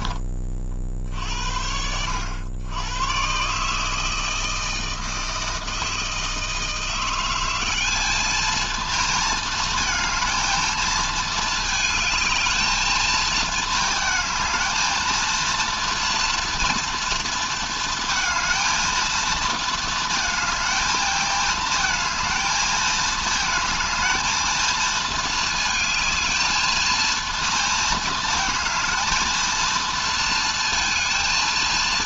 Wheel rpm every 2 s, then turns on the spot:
50, 110, 160, 170, 230, 220, 220, 230, 230, 230, 220, 220, 220, 220, 220, 230.
none